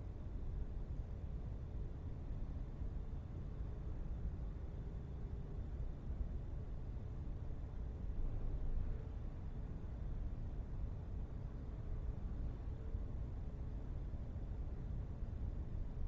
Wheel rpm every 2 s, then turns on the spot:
0, 0, 0, 0, 0, 0, 0, 0.
none